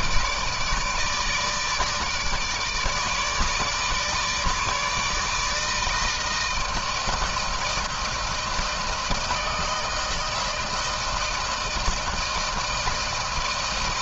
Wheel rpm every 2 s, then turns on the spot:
160, 150, 150, 160, 160, 160, 160.
none